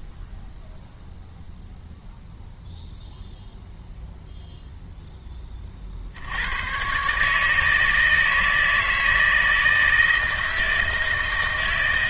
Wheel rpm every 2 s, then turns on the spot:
0, 0, 0, 110, 160, 160.
none